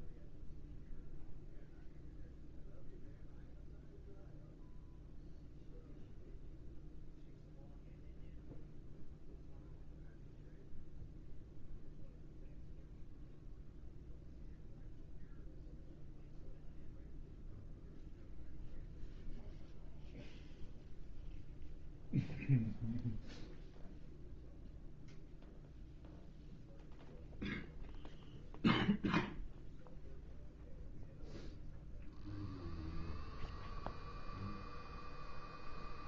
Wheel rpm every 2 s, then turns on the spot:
0, 0, 0, 0, 0, 0, 0, 0, 0, 0, 0, 0, 0, 0, 0, 0, 0, 0.
none